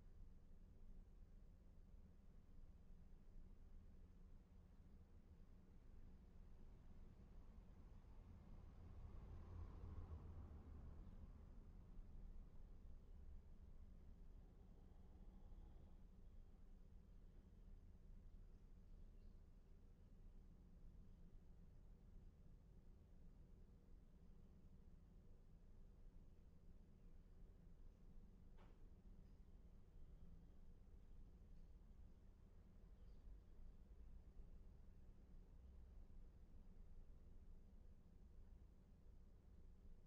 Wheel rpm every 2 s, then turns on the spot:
0, 0, 0, 0, 0, 0, 0, 0, 0, 0, 0, 0, 0, 0, 0, 0, 0, 0, 0, 0.
none